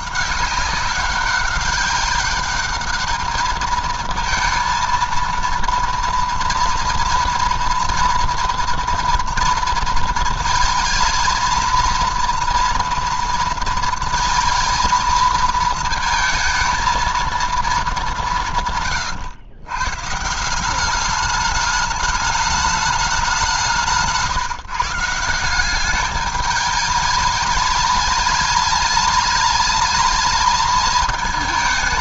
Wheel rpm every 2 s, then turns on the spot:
200, 210, 230, 230, 230, 220, 240, 230, 220, 140, 190, 210, 150, 210, 210, 220.
none